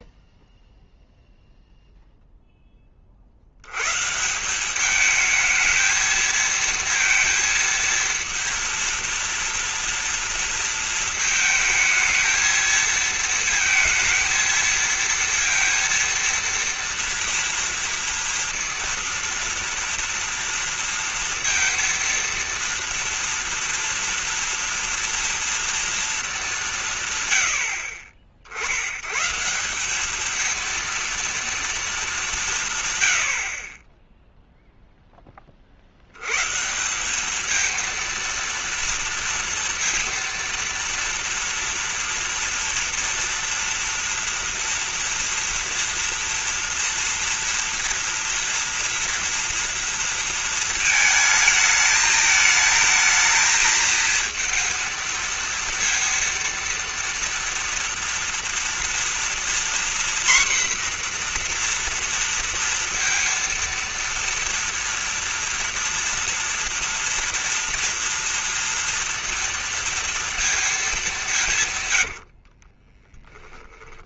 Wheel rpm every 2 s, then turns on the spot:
0, 10, 200, 230, 230, 230, 220, 230, 230, 230, 230, 230, 230, 180, 80, 230, 150, 0, 160, 230, 230, 230, 230, 230, 230, 220, 220, 230, 230, 230, 250, 230, 230, 230, 230, 220, 40.
72-74